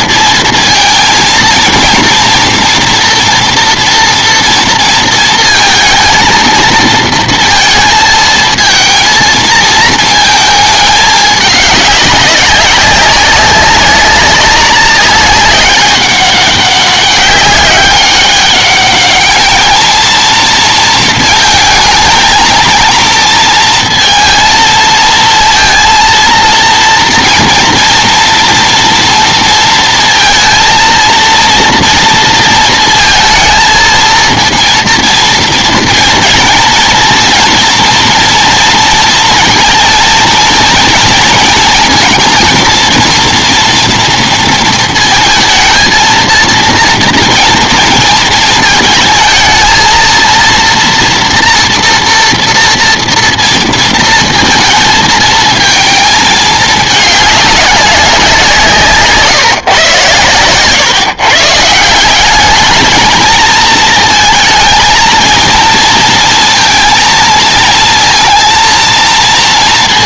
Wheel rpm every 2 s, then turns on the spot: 230, 240, 230, 230, 230, 210, 190, 200, 200, 210, 230, 230, 230, 230, 230, 230, 220, 230, 230, 230, 230, 230, 230, 230, 220, 230, 230, 220, 210, 160, 140, 220, 230, 230, 230.
none